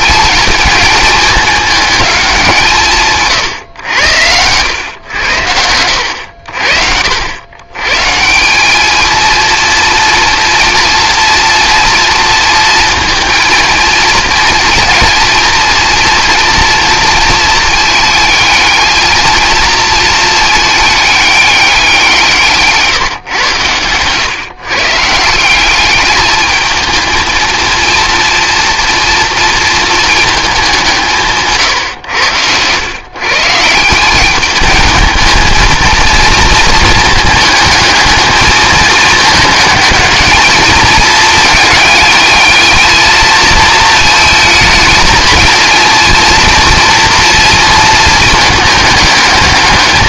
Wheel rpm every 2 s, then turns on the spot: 220, 170, 100, 70, 200, 230, 230, 230, 230, 220, 210, 150, 140, 220, 230, 200, 100, 220, 220, 220, 220, 220, 220, 230, 210.
none